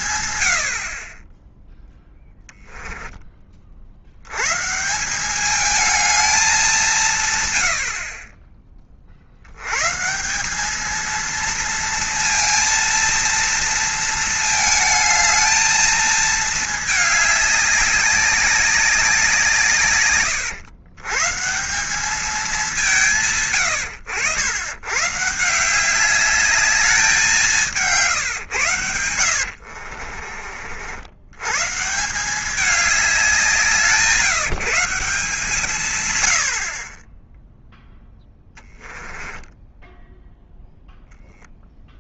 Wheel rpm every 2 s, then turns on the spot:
80, 10, 140, 200, 20, 210, 230, 220, 220, 200, 120, 190, 100, 210, 120, 50, 200, 170, 60, 10, 0.
2-4 38-40